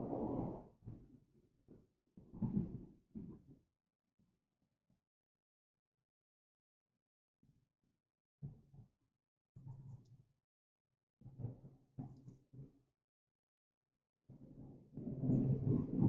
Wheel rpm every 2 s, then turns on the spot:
0, 0, 0, 0, 0, 0, 0, 0.
none